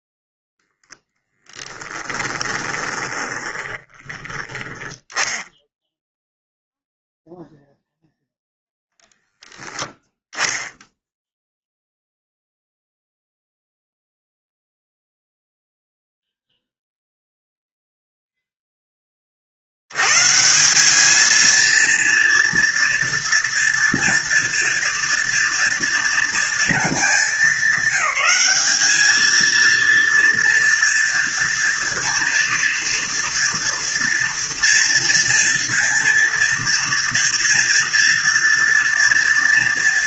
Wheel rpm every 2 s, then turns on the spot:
0, 20, 10, 0, 0, 0, 0, 0, 0, 10, 180, 230, 230, 220, 200, 230, 230, 230, 230, 230.
2-4